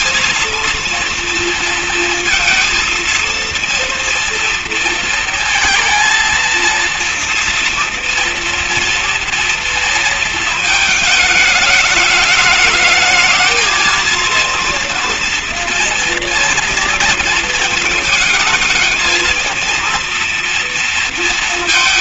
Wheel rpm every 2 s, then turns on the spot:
230, 230, 230, 230, 230, 230, 220, 230, 230, 220, 230.
none